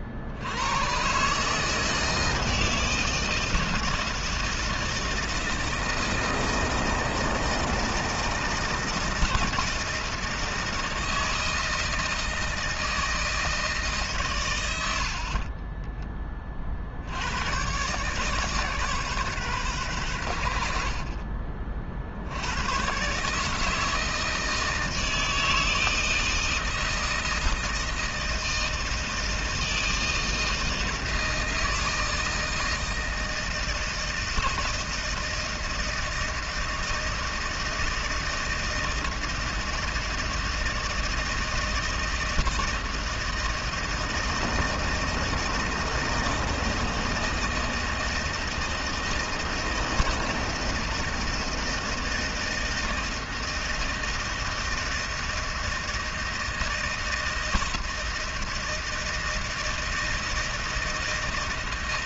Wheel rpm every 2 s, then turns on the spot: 90, 160, 160, 160, 160, 160, 160, 110, 40, 140, 80, 80, 160, 160, 160, 160, 160, 160, 160, 160, 160, 160, 160, 160, 160, 160, 160, 160, 160, 160, 160.
none